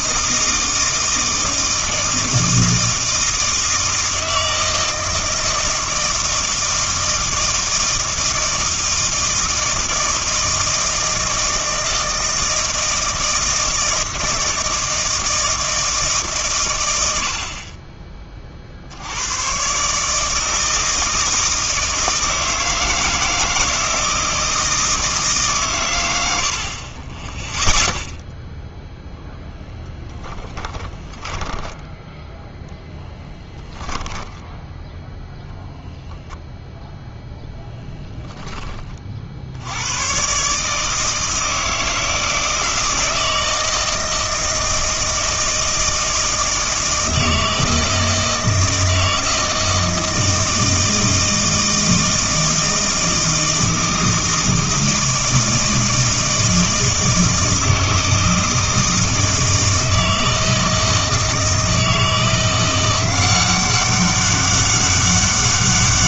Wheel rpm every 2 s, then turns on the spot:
160, 160, 160, 160, 160, 160, 160, 160, 120, 60, 160, 160, 160, 50, 0, 20, 0, 0, 0, 20, 150, 160, 160, 160, 160, 160, 160, 160, 160, 160, 160, 180, 200.
30-32